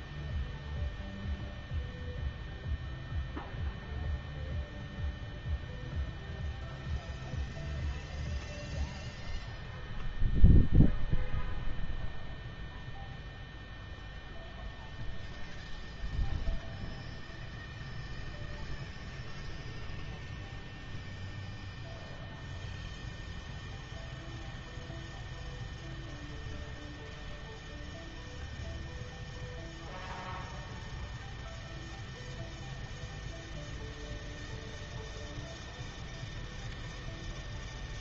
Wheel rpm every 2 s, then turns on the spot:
0, 0, 0, 0, 0, 0, 0, 0, 0, 0, 0, 0, 0, 0, 0, 0, 0, 0, 0.
none